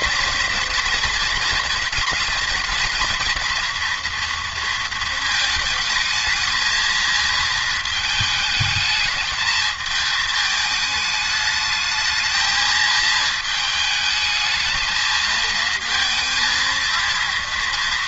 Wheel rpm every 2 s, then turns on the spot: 230, 230, 230, 220, 210, 210, 220, 220, 230.
none